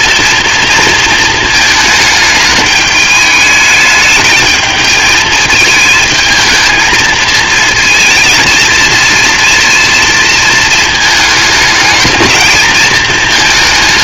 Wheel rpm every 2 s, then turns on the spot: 230, 210, 220, 220, 230, 220, 220.
none